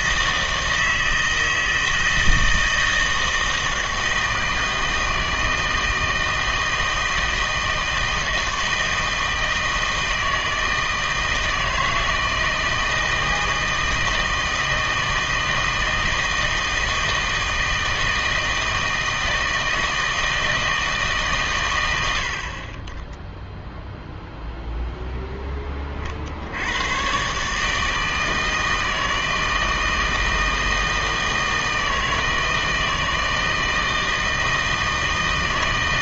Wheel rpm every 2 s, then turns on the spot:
160, 160, 160, 160, 160, 160, 160, 160, 160, 160, 160, 30, 0, 100, 160, 160, 160, 160.
none